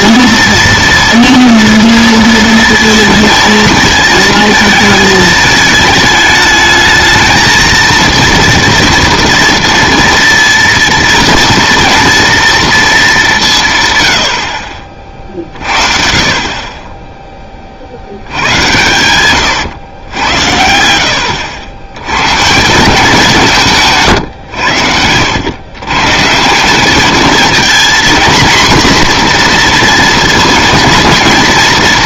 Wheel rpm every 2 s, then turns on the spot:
230, 230, 220, 210, 230, 230, 230, 50, 30, 110, 80, 160, 100, 190, 240, 230.
none